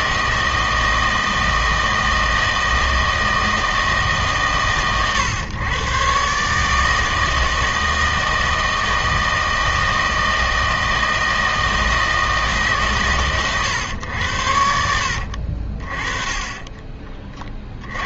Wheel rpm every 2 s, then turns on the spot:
160, 160, 130, 150, 160, 160, 140, 70, 20.
14-16